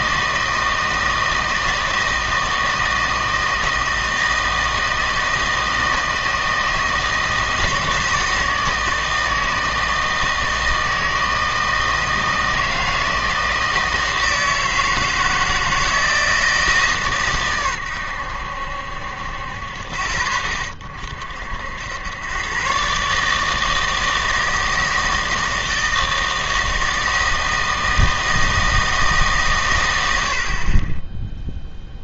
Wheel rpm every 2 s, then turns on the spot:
160, 160, 160, 160, 160, 160, 160, 160, 150, 70, 30, 130, 160, 160, 160, 40.
none